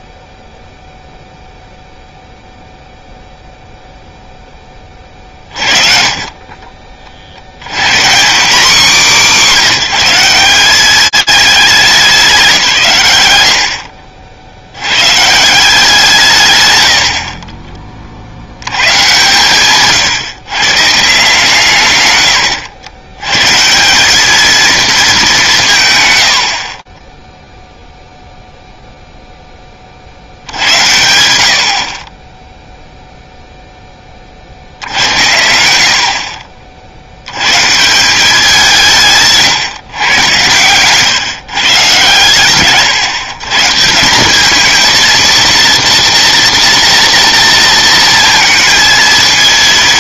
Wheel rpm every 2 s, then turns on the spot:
0, 0, 20, 40, 220, 210, 140, 100, 80, 130, 150, 100, 210, 20, 0, 80, 0, 90, 70, 150, 140, 140, 230, 230, 230.
none